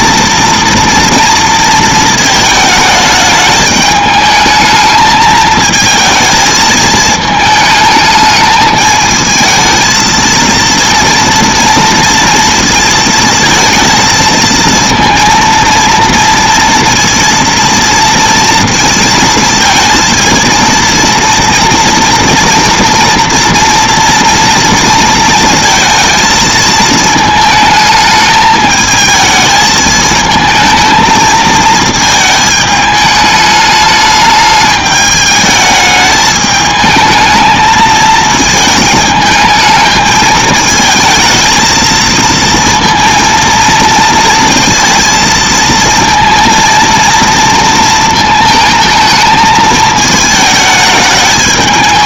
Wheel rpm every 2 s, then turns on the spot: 230, 220, 210, 220, 220, 230, 230, 230, 230, 230, 230, 230, 230, 220, 220, 220, 210, 210, 220, 220, 220, 230, 230, 230, 220, 220.
none